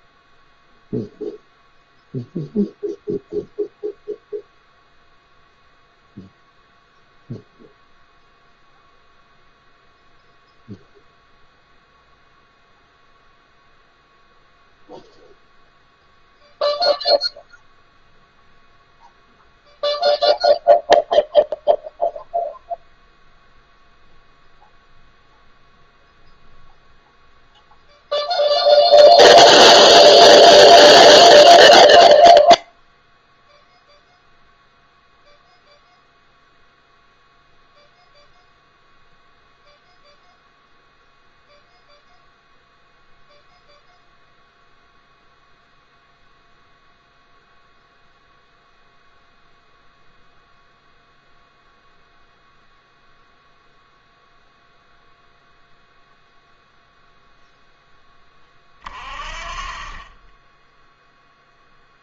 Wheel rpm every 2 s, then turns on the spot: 0, 0, 0, 0, 0, 0, 0, 0, 0, 0, 0, 0, 0, 0, 0, 0, 0, 0, 0, 0, 0, 0, 0, 0, 0, 0, 0, 0, 0, 40, 10.
none